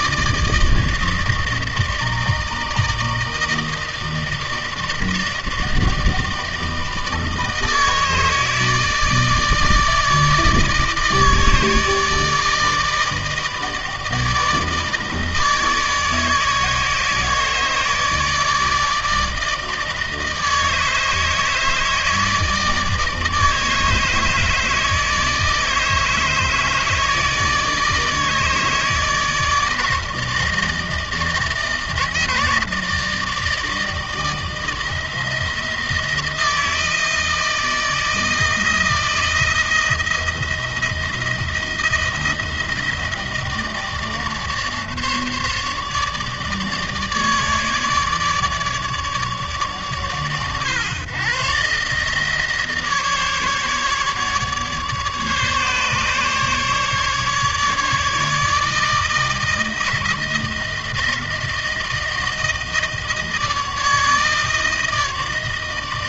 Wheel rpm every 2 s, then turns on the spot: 160, 160, 160, 160, 160, 160, 160, 160, 160, 160, 160, 160, 150, 150, 160, 160, 160, 160, 160, 160, 170, 160, 150, 150, 150, 130, 150, 150, 150, 150, 160, 160, 160.
none